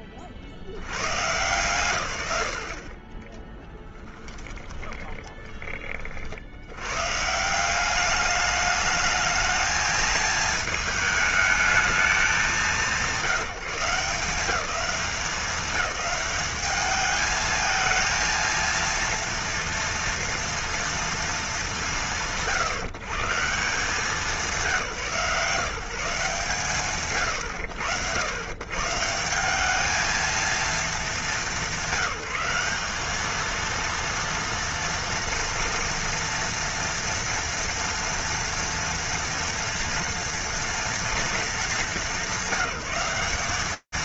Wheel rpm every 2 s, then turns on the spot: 10, 100, 10, 60, 210, 220, 180, 200, 210, 230, 230, 120, 170, 150, 110, 220, 190, 230, 230, 230, 230, 200.
4-6